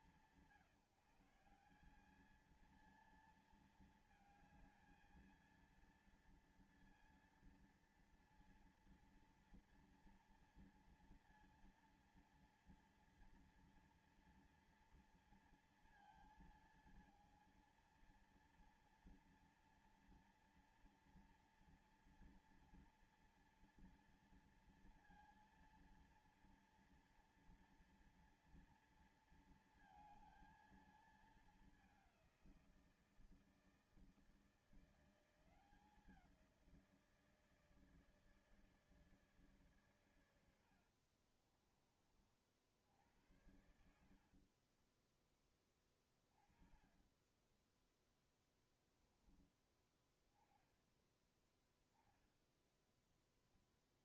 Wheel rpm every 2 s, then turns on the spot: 170, 220, 220, 230, 230, 230, 230, 230, 230, 230, 240, 230, 230, 230, 230, 220, 170, 170, 170, 160, 70, 60, 30, 20, 10, 10, 10.
40-42 44-48